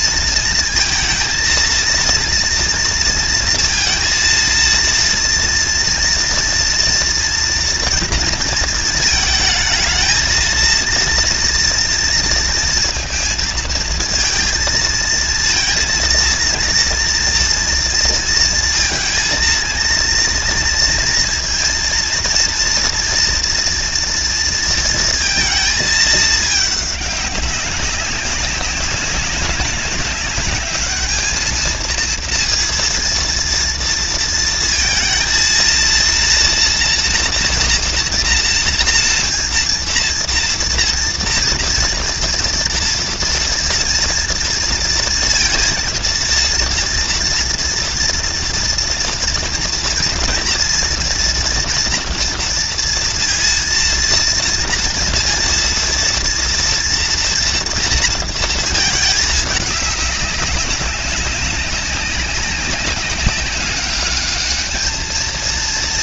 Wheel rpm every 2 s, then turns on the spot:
230, 230, 230, 230, 220, 230, 230, 220, 230, 230, 230, 230, 230, 210, 200, 210, 230, 220, 230, 240, 240, 230, 230, 230, 230, 240, 230, 230, 230, 230, 190, 190, 210.
none